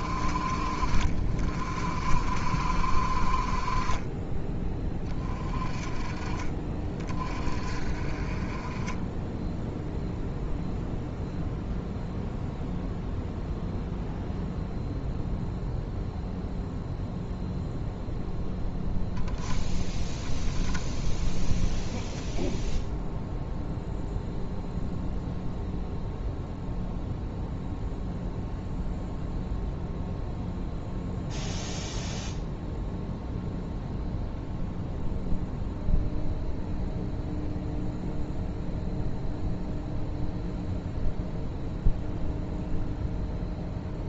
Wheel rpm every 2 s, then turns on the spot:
30, 40, 20, 40, 20, 0, 0, 0, 0, 0, 10, 0, 0, 0, 0, 0, 0, 0, 0, 0, 0, 0.
none